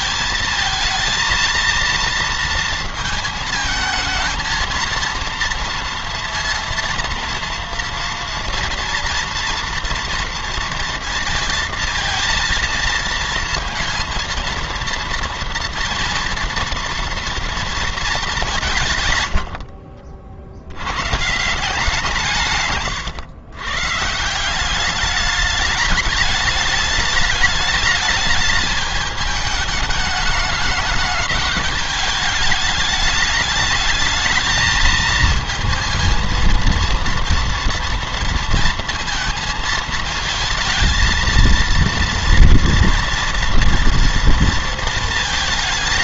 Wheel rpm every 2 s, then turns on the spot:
220, 220, 230, 230, 230, 230, 230, 230, 230, 150, 110, 130, 190, 210, 210, 210, 210, 220, 230, 230, 230, 230, 230.
none